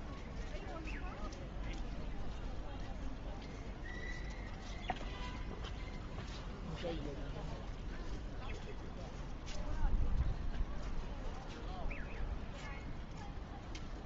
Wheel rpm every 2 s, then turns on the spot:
0, 0, 0, 0, 0, 0, 0.
none